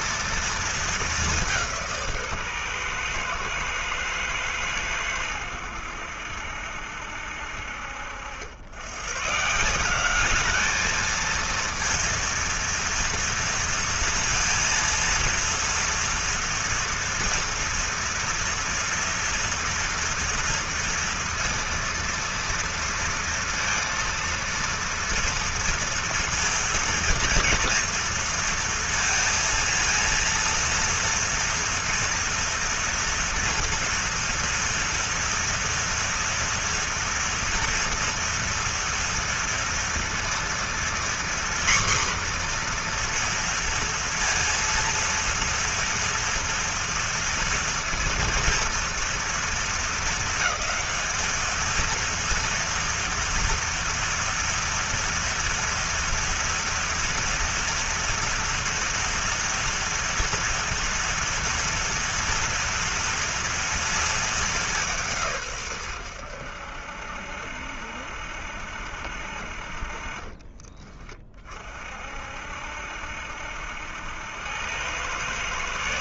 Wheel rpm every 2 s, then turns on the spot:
210, 120, 100, 70, 110, 220, 230, 230, 230, 230, 230, 230, 230, 230, 230, 230, 230, 230, 230, 230, 240, 240, 230, 230, 230, 220, 240, 230, 230, 230, 230, 230, 170, 70, 60, 30, 60, 110.
none